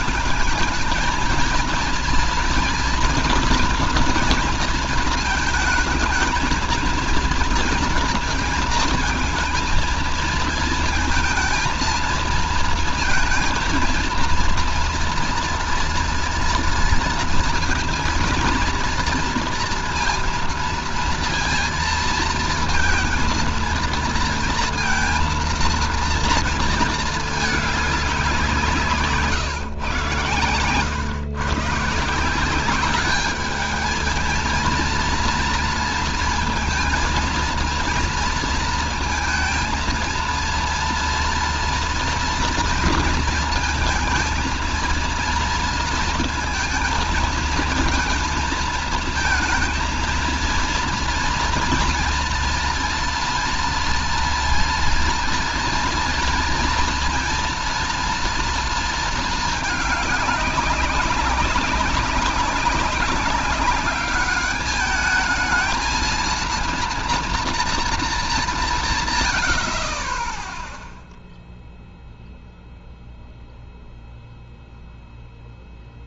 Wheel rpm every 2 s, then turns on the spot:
220, 230, 230, 220, 230, 230, 230, 230, 230, 230, 230, 230, 230, 230, 170, 110, 180, 220, 230, 230, 230, 230, 220, 230, 220, 230, 230, 230, 230, 230, 200, 200, 210, 230, 190, 10, 0, 0.
none